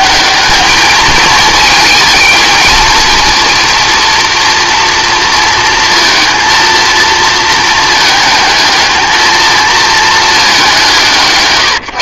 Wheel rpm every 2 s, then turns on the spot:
200, 220, 230, 230, 220, 200.
none